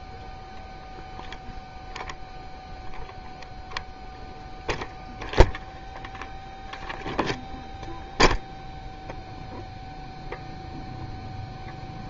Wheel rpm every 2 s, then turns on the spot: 0, 0, 0, 0, 0, 0.
none